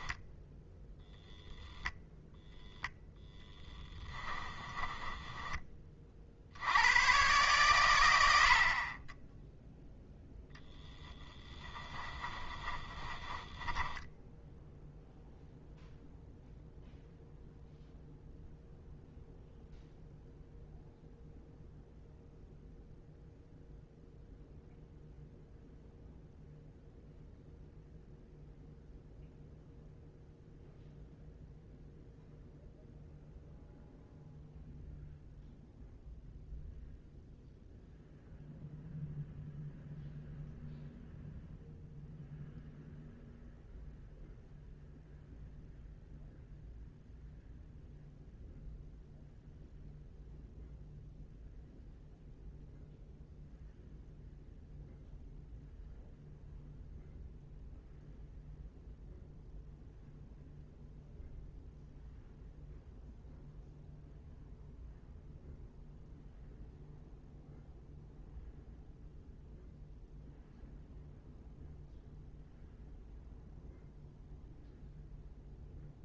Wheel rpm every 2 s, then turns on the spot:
10, 10, 20, 120, 0, 10, 10, 0, 0, 0, 0, 0, 0, 0, 0, 0, 0, 0, 0, 0, 0, 0, 0, 0, 0, 0, 0, 0, 0, 0, 0, 0, 0, 0, 0, 0, 0, 0.
4-6 10-14